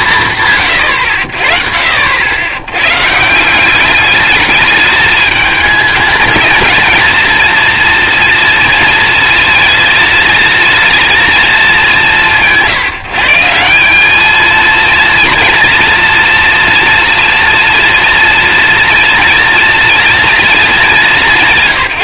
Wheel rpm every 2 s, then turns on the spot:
50, 180, 210, 230, 220, 220, 170, 230, 240, 240, 200.
none